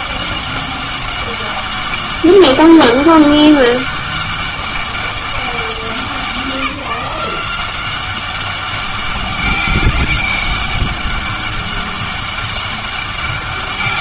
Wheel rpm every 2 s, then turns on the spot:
200, 200, 200, 170, 200, 200, 200.
none